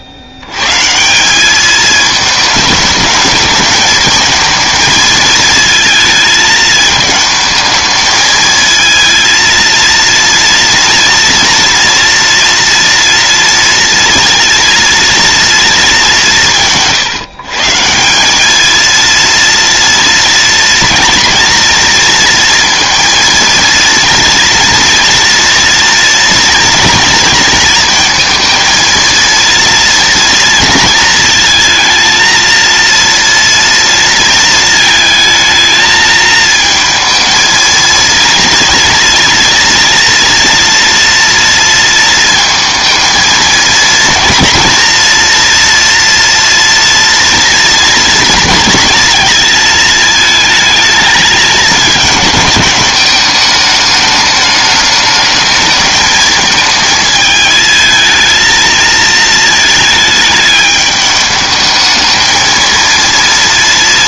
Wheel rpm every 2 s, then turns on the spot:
110, 210, 220, 220, 220, 230, 230, 230, 180, 210, 230, 230, 230, 230, 230, 230, 230, 220, 220, 230, 230, 220, 230, 230, 230, 220, 210, 210, 220, 220, 210, 220.
none